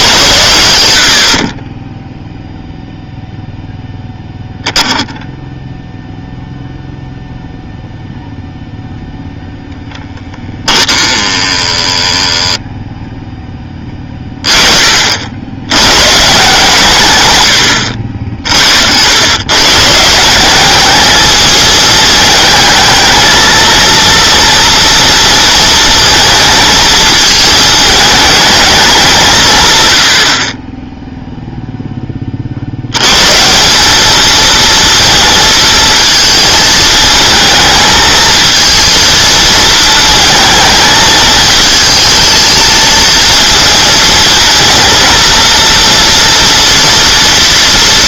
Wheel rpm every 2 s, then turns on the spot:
90, 0, 0, 0, 0, 10, 0, 30, 140, 60, 200, 220, 230, 220, 210, 20, 70, 230, 220, 220, 220, 220, 230, 230.
none